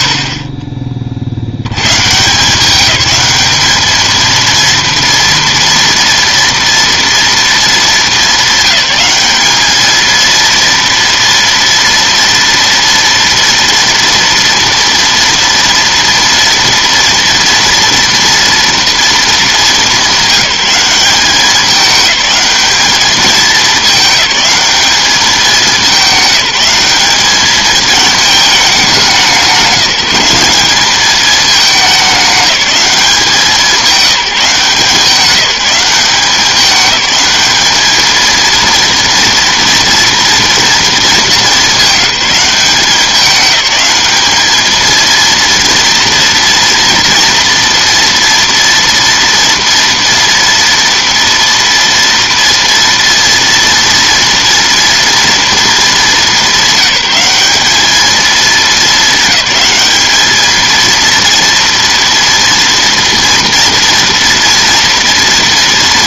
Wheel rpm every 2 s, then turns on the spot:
30, 180, 230, 230, 200, 230, 230, 230, 230, 230, 190, 210, 210, 190, 210, 200, 200, 170, 200, 230, 230, 180, 220, 230, 230, 230, 230, 230, 200, 210, 220, 230, 230.
none